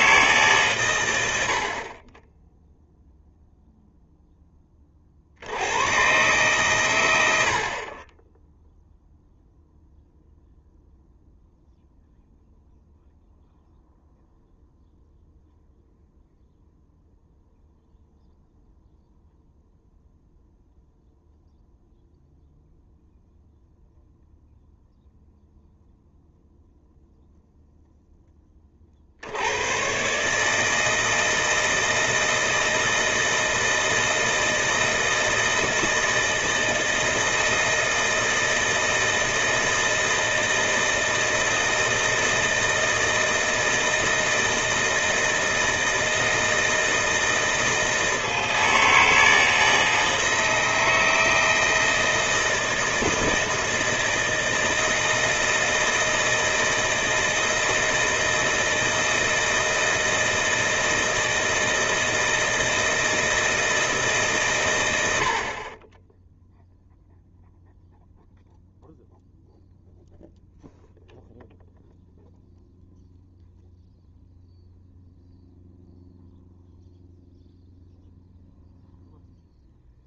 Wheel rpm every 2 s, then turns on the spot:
140, 10, 10, 130, 10, 0, 0, 0, 0, 0, 0, 0, 0, 0, 30, 150, 160, 160, 160, 160, 160, 160, 160, 160, 160, 160, 160, 160, 160, 160, 160, 160, 130, 0, 0, 0, 0, 0, 0, 0.
none